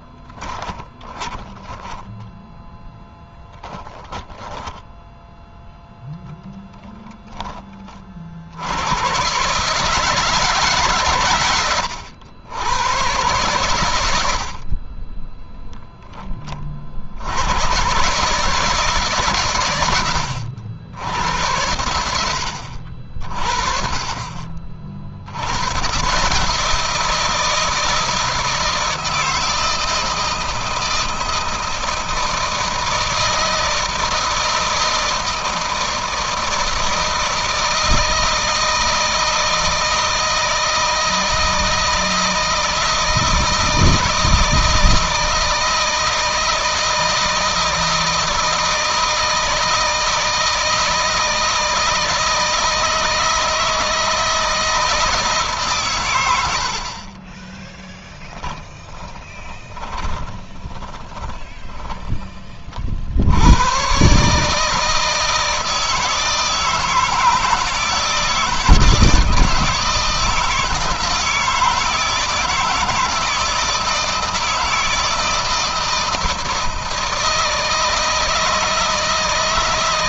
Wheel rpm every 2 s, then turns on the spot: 20, 10, 10, 0, 90, 140, 110, 40, 40, 150, 90, 70, 40, 170, 160, 160, 160, 160, 160, 160, 160, 170, 160, 160, 160, 160, 160, 160, 70, 20, 20, 40, 160, 160, 160, 160, 160, 160, 160, 160.
0-6 56-62